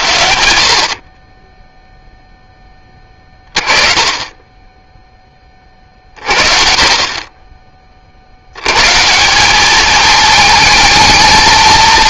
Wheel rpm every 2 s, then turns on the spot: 80, 10, 10, 40, 140, 220.
none